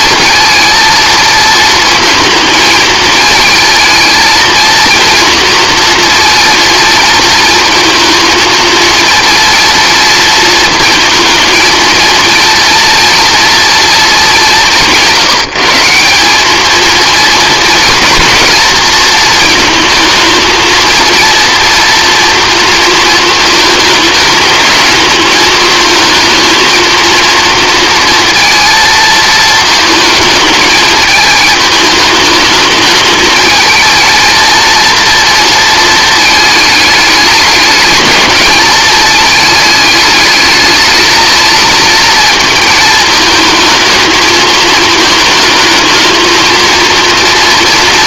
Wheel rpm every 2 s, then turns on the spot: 230, 220, 230, 230, 230, 230, 230, 180, 220, 230, 230, 230, 210, 230, 230, 220, 220, 230, 210, 220, 220, 220, 220, 230.
none